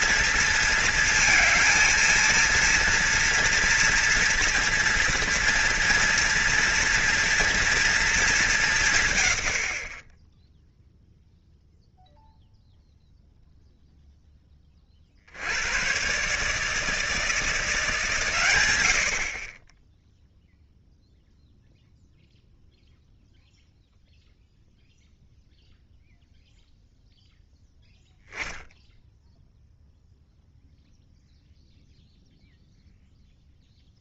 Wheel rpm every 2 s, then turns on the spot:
230, 230, 230, 230, 180, 0, 0, 30, 160, 110, 0, 0, 0, 0, 0, 0, 0.
none